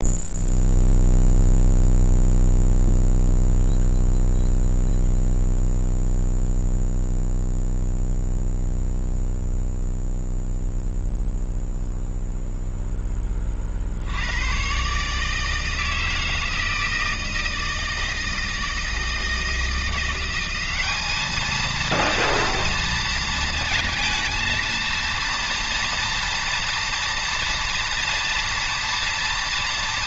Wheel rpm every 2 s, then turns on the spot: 0, 0, 0, 0, 0, 0, 0, 110, 160, 160, 190, 230, 230, 230, 230.
none